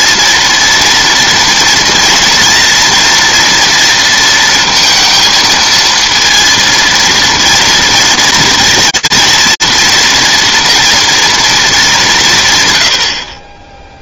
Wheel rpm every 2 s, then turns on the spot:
230, 230, 230, 230, 230, 230, 100.
none